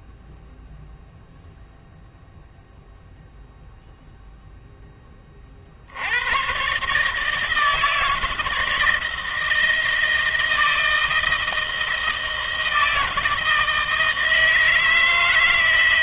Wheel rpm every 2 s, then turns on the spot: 0, 0, 0, 120, 160, 160, 160, 160.
none